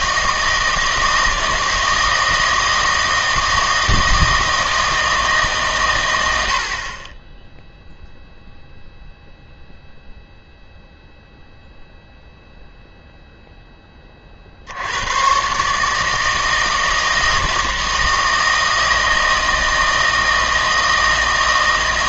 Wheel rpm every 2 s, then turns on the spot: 160, 160, 160, 60, 0, 0, 0, 70, 160, 160, 160.
none